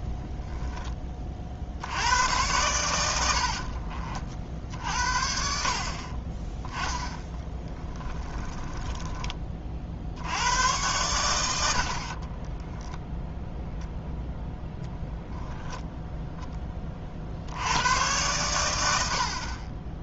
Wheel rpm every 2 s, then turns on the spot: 10, 100, 60, 20, 10, 100, 10, 0, 20, 100.
8-10 12-14